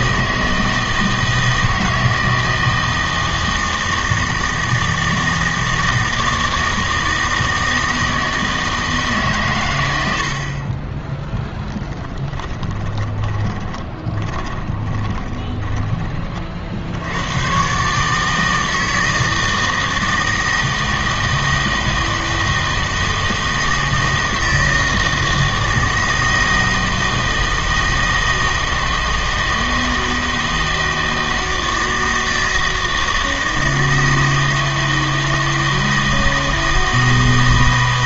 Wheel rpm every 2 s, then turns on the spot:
160, 160, 160, 160, 160, 30, 10, 20, 70, 160, 160, 160, 160, 160, 160, 160, 160, 160, 160.
12-16